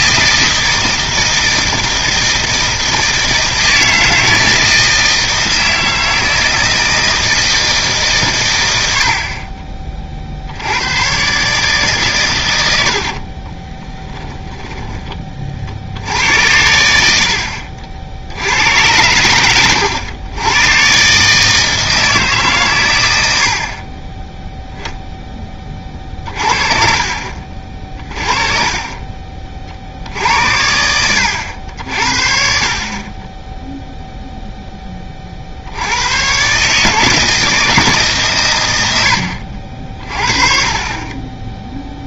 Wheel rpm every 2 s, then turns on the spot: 160, 160, 160, 160, 90, 90, 90, 20, 80, 90, 120, 130, 0, 50, 30, 90, 50, 20, 140, 100, 40.
12-16